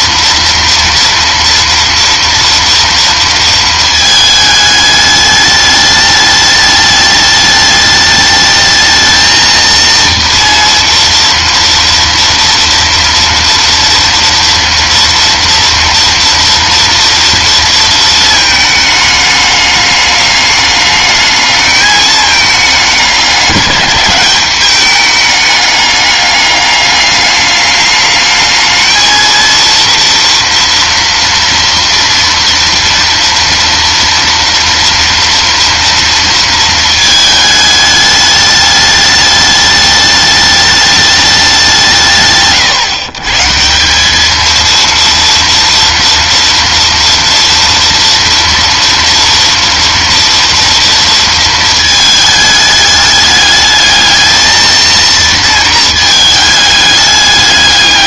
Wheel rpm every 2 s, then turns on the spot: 230, 230, 210, 210, 220, 230, 230, 230, 230, 220, 210, 210, 200, 200, 220, 240, 230, 230, 230, 210, 210, 130, 220, 230, 230, 230, 210, 230, 210.
none